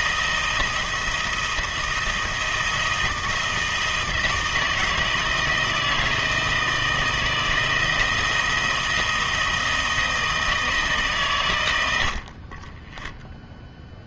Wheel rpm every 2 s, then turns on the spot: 170, 160, 160, 170, 160, 160, 50.
none